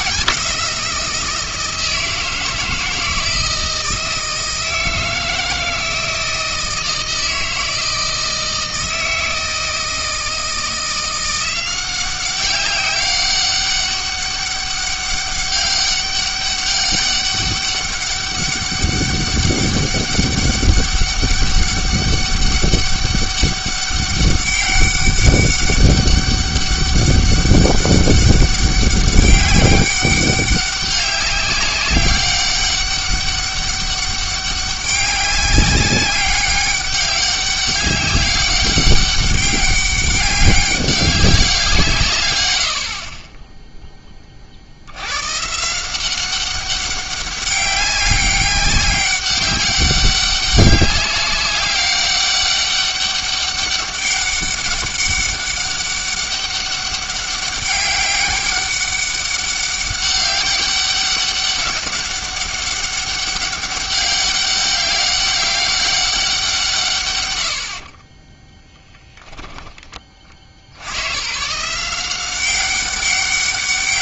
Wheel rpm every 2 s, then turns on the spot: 190, 170, 160, 160, 160, 170, 190, 200, 200, 200, 200, 200, 200, 200, 200, 190, 200, 190, 200, 200, 190, 90, 60, 190, 200, 200, 200, 200, 200, 190, 200, 200, 200, 150, 10, 70, 190.
none